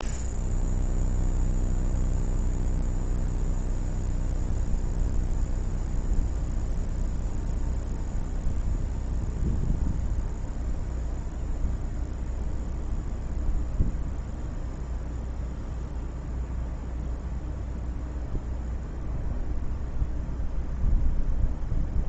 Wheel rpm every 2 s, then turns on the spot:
0, 0, 0, 0, 0, 0, 0, 0, 0, 0, 0.
none